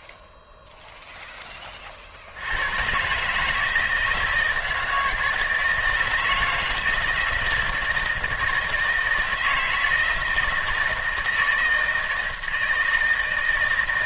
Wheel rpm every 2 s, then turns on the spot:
0, 100, 160, 160, 160, 160, 160.
none